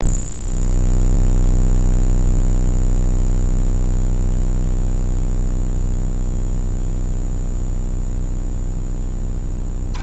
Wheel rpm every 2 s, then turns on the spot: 0, 0, 0, 0, 0.
none